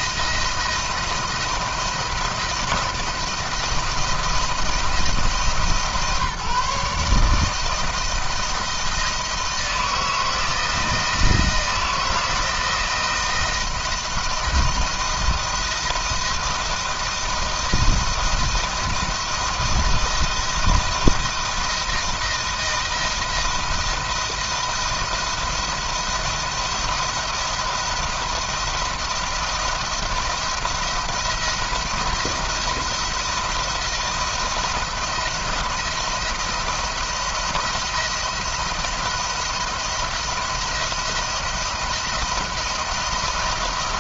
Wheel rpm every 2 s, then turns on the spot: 170, 170, 160, 150, 160, 160, 170, 160, 160, 160, 170, 170, 170, 170, 170, 170, 170, 170, 170, 170, 170, 170.
none